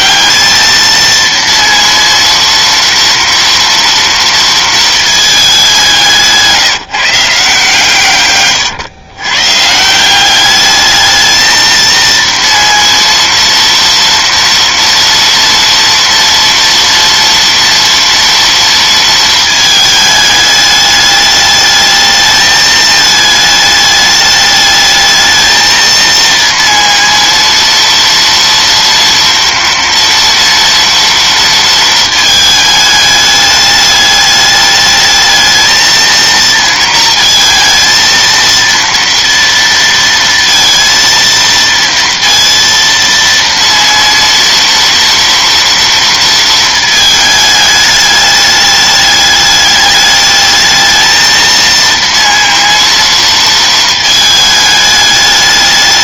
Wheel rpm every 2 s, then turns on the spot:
220, 230, 220, 160, 120, 210, 230, 230, 240, 230, 210, 220, 210, 230, 230, 230, 210, 210, 230, 230, 230, 230, 230, 220, 210, 220, 230, 210.
none